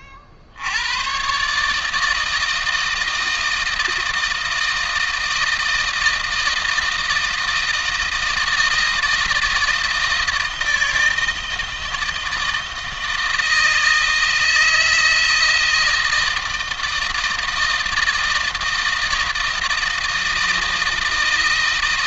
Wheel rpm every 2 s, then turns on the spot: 80, 160, 160, 160, 160, 160, 160, 160, 160, 160, 160.
none